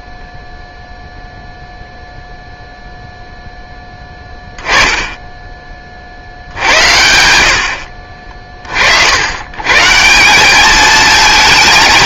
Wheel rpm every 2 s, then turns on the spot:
0, 0, 10, 70, 40, 200.
none